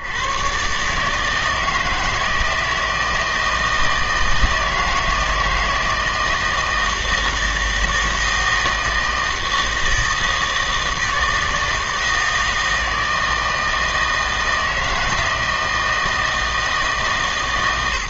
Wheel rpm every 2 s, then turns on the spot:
130, 160, 160, 160, 160, 160, 160, 160, 160.
none